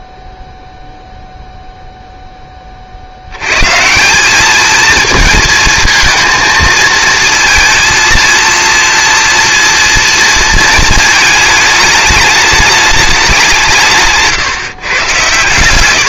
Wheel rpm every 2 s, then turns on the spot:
0, 30, 220, 230, 230, 220, 210, 140.
none